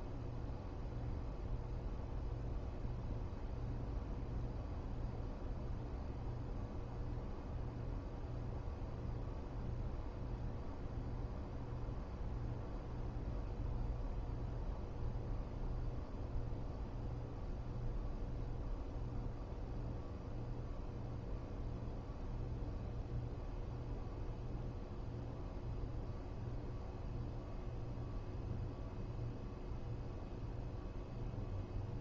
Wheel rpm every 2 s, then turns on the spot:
0, 0, 0, 0, 0, 0, 0, 0, 0, 0, 0, 0, 0, 0, 0, 0.
none